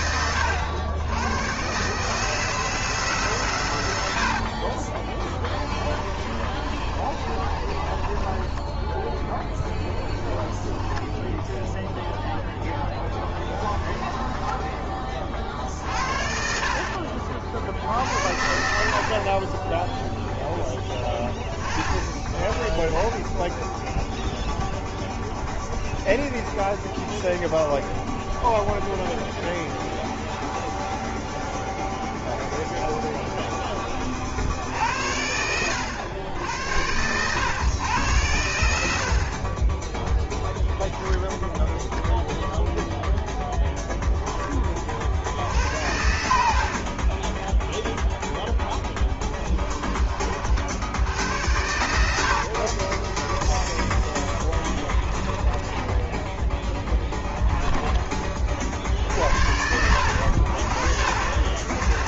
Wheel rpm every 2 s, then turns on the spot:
90, 160, 40, 30, 20, 10, 10, 20, 60, 60, 10, 10, 0, 0, 0, 0, 0, 60, 90, 80, 0, 0, 30, 50, 0, 60, 40, 30, 10, 50, 60.
4-10 46-48 52-58